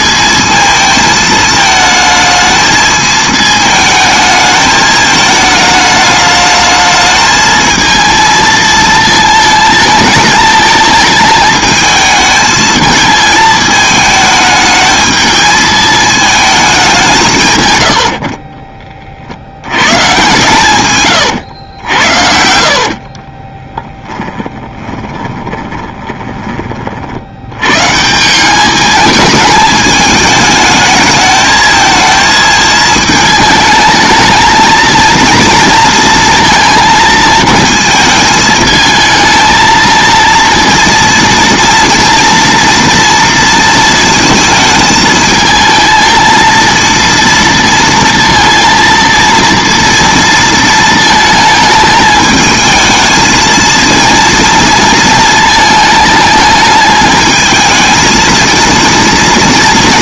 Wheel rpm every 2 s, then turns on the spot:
220, 220, 220, 210, 220, 220, 220, 220, 210, 30, 120, 60, 20, 30, 200, 210, 220, 230, 230, 220, 230, 230, 220, 230, 230, 230, 220, 220, 220, 230.
18-20 22-26